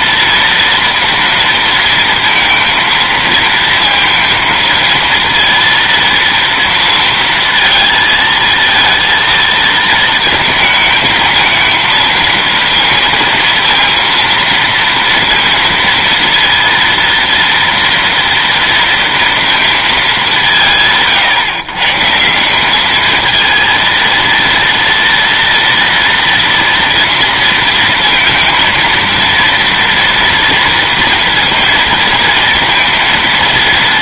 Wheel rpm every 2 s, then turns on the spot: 230, 230, 230, 230, 230, 230, 230, 230, 230, 200, 170, 230, 230, 220, 230, 230, 220.
none